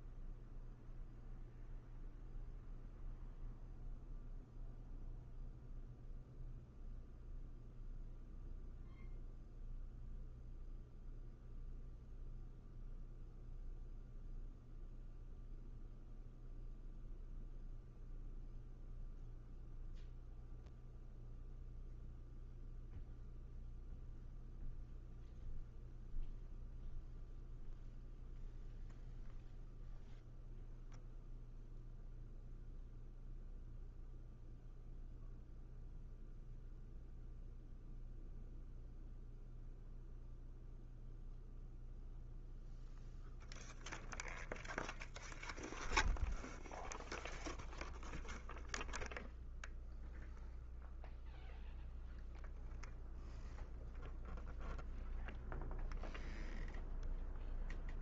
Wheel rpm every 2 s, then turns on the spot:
0, 0, 0, 0, 0, 0, 0, 0, 0, 0, 0, 0, 0, 0, 0, 0, 0, 0, 0, 0, 0, 0, 0, 0, 0, 0, 0, 0, 0.
none